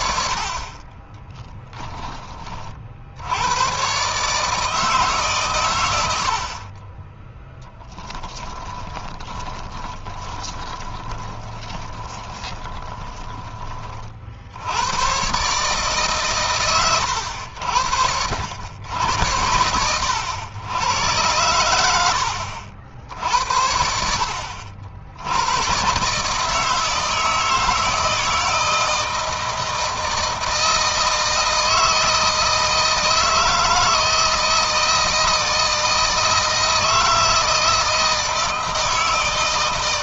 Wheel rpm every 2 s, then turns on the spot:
30, 50, 150, 30, 20, 30, 20, 90, 100, 80, 100, 70, 70, 160, 160, 160, 160, 160, 160, 160.
8-14